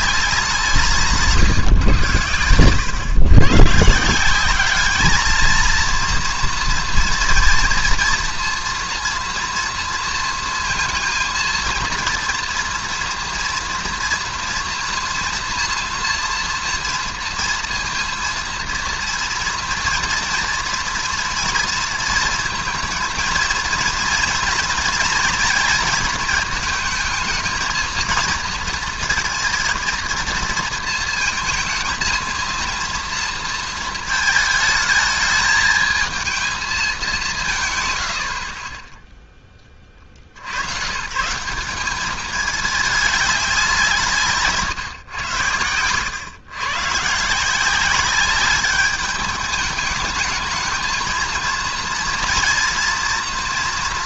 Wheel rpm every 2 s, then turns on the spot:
170, 110, 200, 230, 230, 230, 240, 240, 230, 230, 230, 230, 230, 220, 230, 230, 230, 220, 220, 30, 80, 210, 140, 120, 200, 220, 230.
none